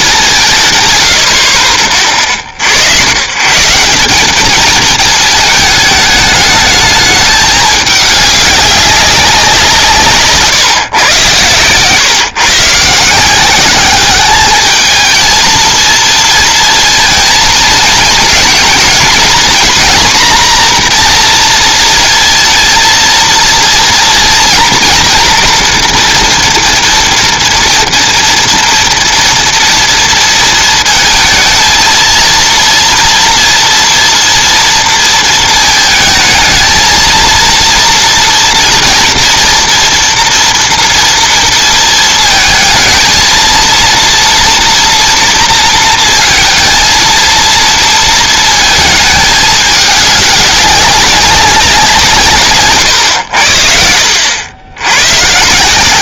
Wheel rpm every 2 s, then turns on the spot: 130, 70, 220, 210, 200, 140, 140, 210, 230, 220, 240, 230, 240, 230, 230, 220, 230, 230, 220, 230, 230, 220, 230, 230, 220, 200, 130, 90.
52-54